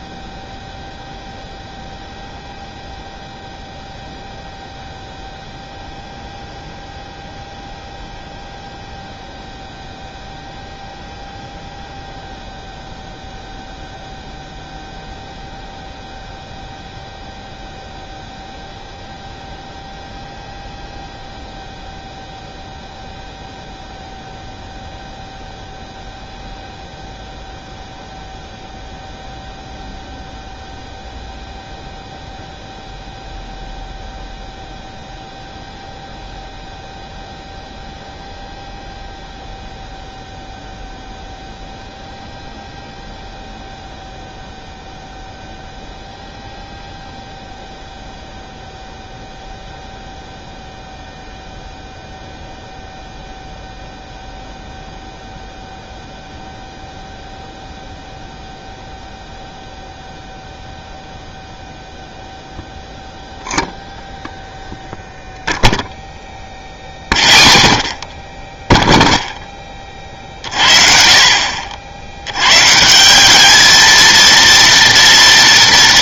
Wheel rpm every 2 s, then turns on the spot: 0, 0, 0, 0, 0, 0, 0, 0, 0, 0, 0, 0, 0, 0, 0, 0, 0, 0, 0, 0, 0, 0, 0, 0, 0, 0, 0, 0, 0, 0, 0, 0, 0, 0, 0, 50, 120, 230.
none